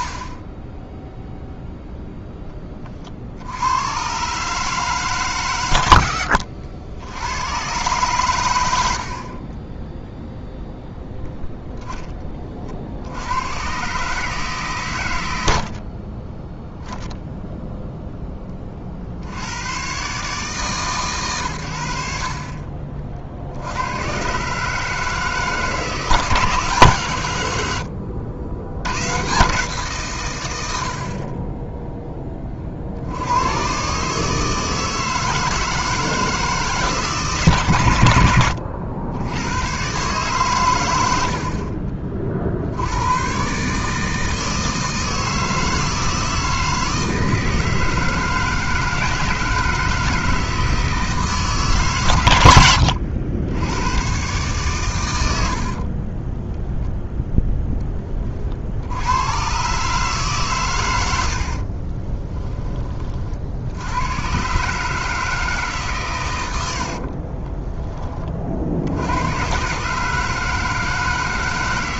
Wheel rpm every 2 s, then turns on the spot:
10, 30, 150, 80, 70, 0, 60, 140, 10, 40, 140, 40, 150, 140, 90, 70, 60, 160, 150, 80, 100, 90, 160, 160, 160, 160, 80, 110, 0, 80, 110, 30, 150, 60, 80, 160.
52-54 66-68